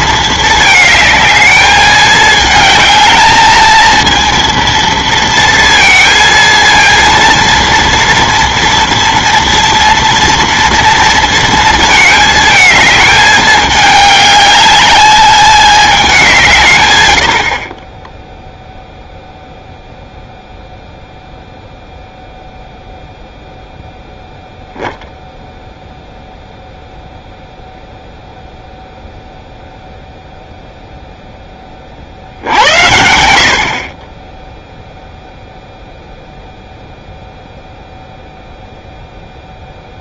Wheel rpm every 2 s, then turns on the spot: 220, 220, 230, 230, 230, 230, 220, 210, 130, 0, 0, 0, 0, 0, 0, 0, 70, 0, 0, 0.
none